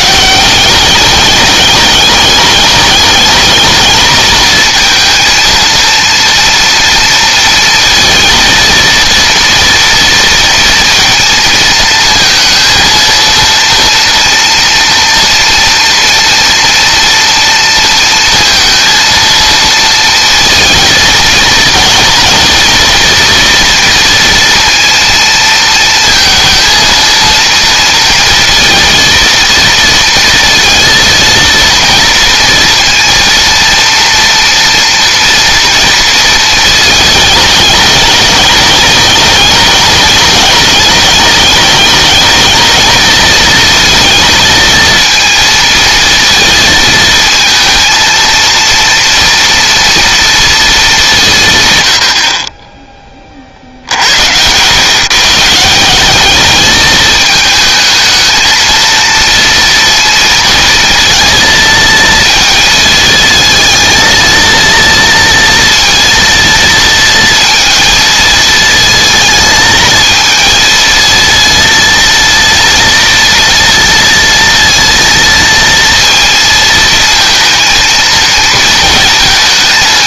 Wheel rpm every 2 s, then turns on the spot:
200, 210, 230, 230, 230, 230, 230, 230, 230, 230, 230, 230, 230, 230, 230, 230, 230, 240, 220, 210, 210, 220, 230, 230, 230, 220, 30, 120, 210, 220, 230, 230, 230, 230, 220, 230, 230, 230, 220, 230.
none